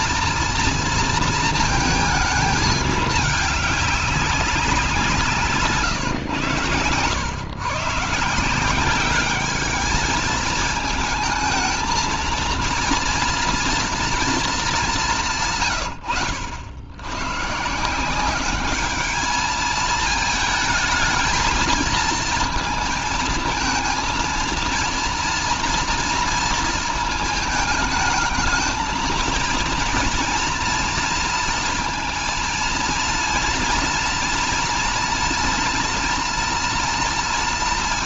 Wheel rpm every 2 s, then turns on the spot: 230, 220, 180, 110, 200, 220, 230, 200, 90, 210, 220, 220, 230, 230, 220, 230, 230, 230, 230.
none